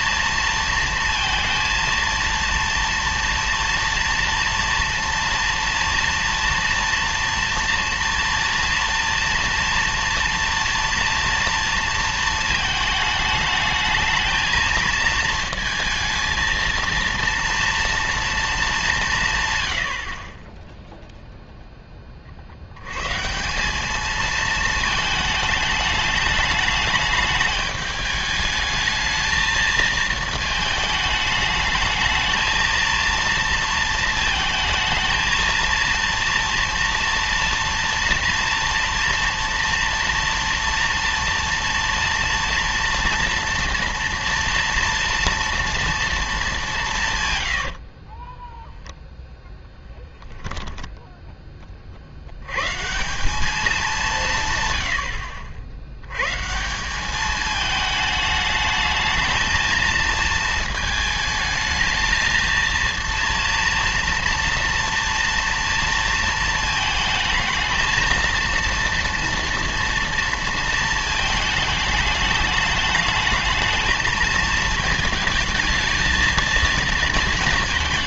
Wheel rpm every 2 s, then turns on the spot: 230, 230, 230, 230, 230, 230, 220, 220, 230, 220, 10, 60, 220, 210, 210, 220, 230, 230, 230, 230, 230, 230, 230, 210, 10, 10, 120, 120, 150, 210, 220, 230, 230, 220, 230, 230, 210, 220, 230.
48-50